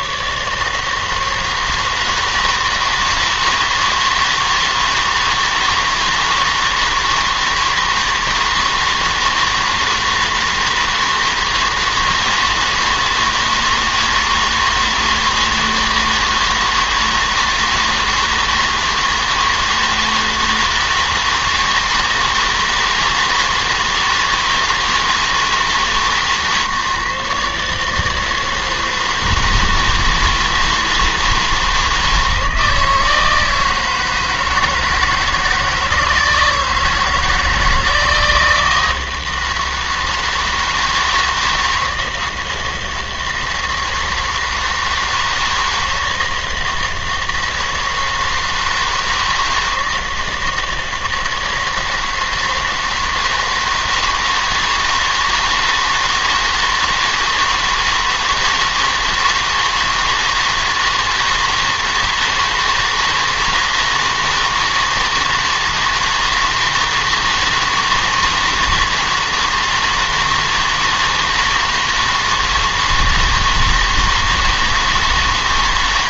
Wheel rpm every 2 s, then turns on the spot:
150, 160, 160, 160, 160, 160, 160, 160, 160, 160, 160, 160, 160, 150, 160, 160, 160, 160, 170, 160, 160, 160, 160, 160, 160, 160, 160, 160, 160, 160, 160, 160, 160, 160, 160, 160, 160, 160.
none